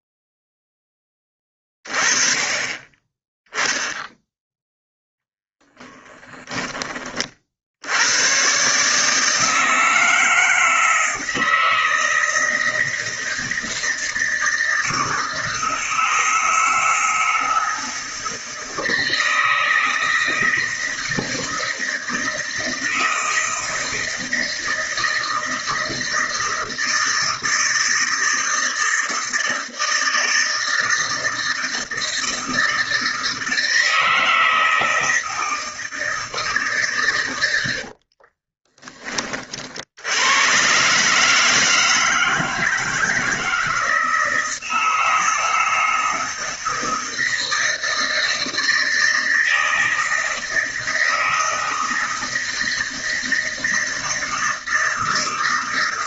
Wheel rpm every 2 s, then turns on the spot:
0, 20, 0, 20, 130, 160, 160, 160, 160, 160, 160, 160, 160, 160, 160, 160, 160, 160, 150, 20, 120, 160, 160, 160, 160, 160, 160, 160.
38-40